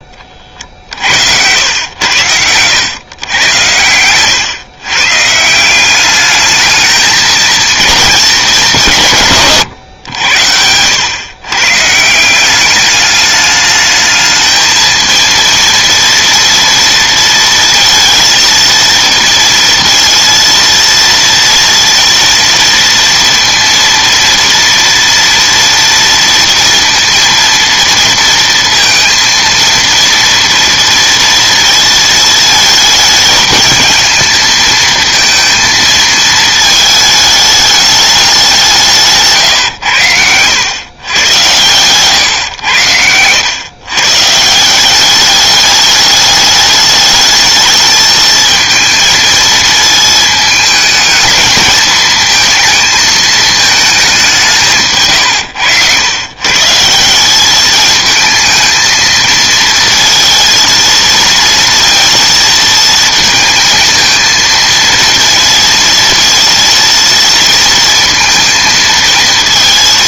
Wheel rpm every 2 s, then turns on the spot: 50, 100, 130, 220, 200, 90, 200, 220, 230, 230, 230, 230, 230, 230, 230, 230, 220, 220, 220, 170, 110, 100, 180, 210, 220, 220, 220, 160, 160, 220, 230, 230, 230, 230, 220.
none